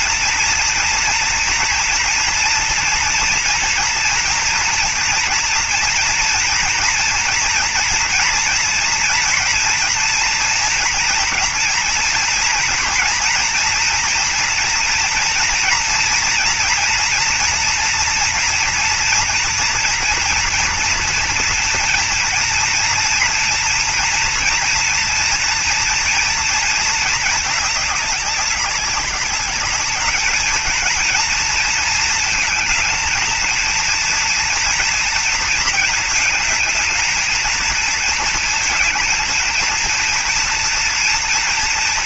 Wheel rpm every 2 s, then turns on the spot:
230, 230, 230, 240, 230, 230, 230, 230, 230, 240, 230, 230, 230, 230, 200, 220, 230, 230, 220, 230, 230.
none